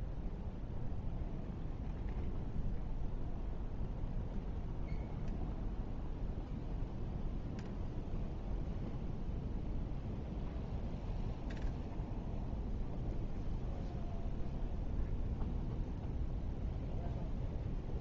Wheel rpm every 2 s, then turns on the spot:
0, 0, 0, 0, 0, 0, 0, 0, 0.
none